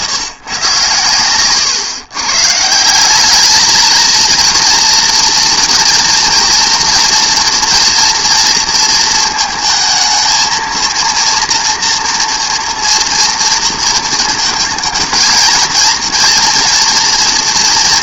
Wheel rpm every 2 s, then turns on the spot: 120, 190, 230, 230, 230, 230, 230, 230, 230.
none